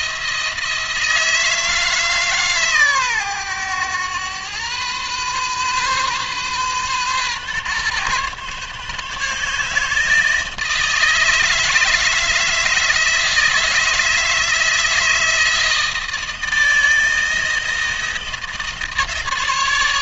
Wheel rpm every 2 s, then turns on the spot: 160, 130, 120, 130, 140, 160, 160, 160, 160, 160.
none